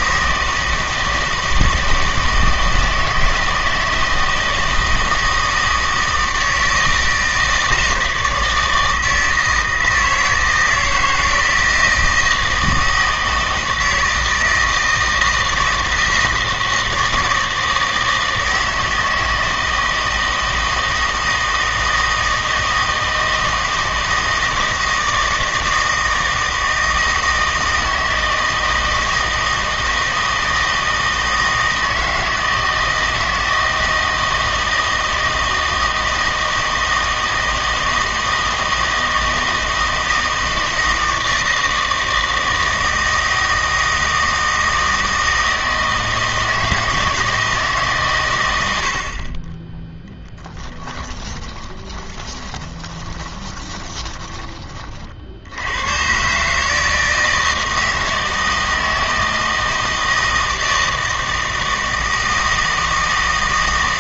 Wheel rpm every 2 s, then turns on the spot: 160, 160, 160, 160, 160, 160, 160, 160, 160, 160, 160, 160, 160, 160, 160, 160, 160, 160, 160, 160, 160, 160, 160, 160, 90, 10, 20, 40, 150, 160, 160, 160.
50-54